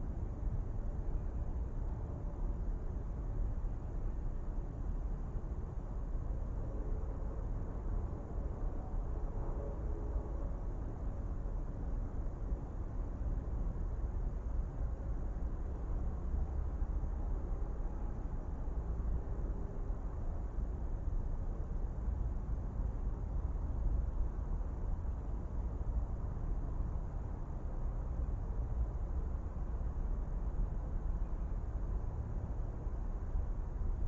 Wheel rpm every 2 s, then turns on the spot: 0, 0, 0, 0, 0, 0, 0, 0, 0, 0, 0, 0, 0, 0, 0, 0, 0.
none